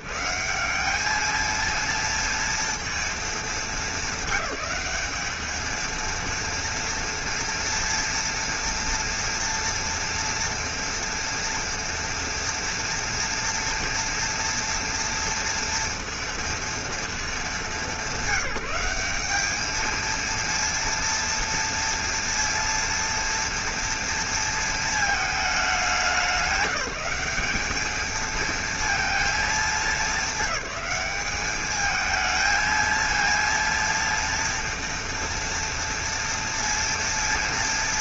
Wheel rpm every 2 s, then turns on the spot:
110, 230, 210, 230, 230, 230, 230, 230, 230, 200, 230, 230, 230, 200, 220, 200, 220, 230, 230.
none